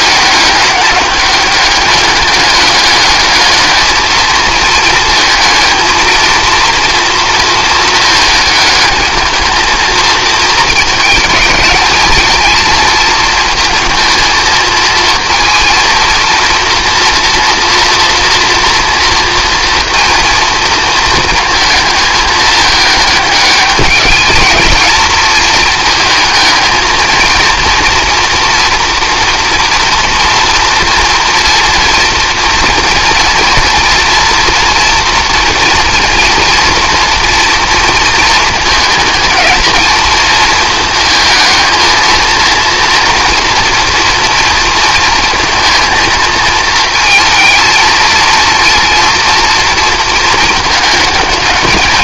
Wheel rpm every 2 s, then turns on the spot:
200, 200, 220, 230, 220, 220, 220, 220, 230, 240, 230, 210, 220, 230, 240, 230, 240, 240, 240, 220, 230, 240, 230, 220, 230, 220.
none